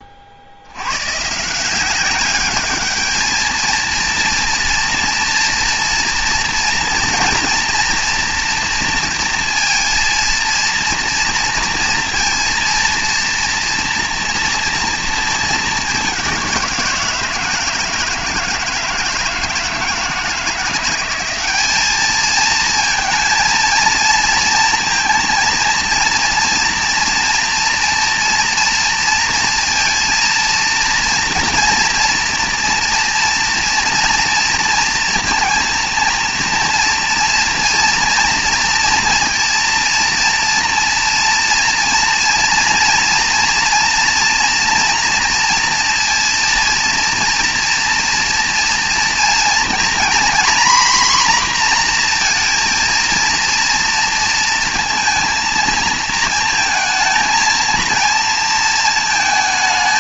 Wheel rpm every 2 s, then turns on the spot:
70, 200, 230, 230, 230, 230, 230, 240, 180, 160, 170, 220, 230, 230, 230, 230, 230, 230, 230, 230, 230, 230, 230, 230, 230, 250, 230, 230, 230, 230.
none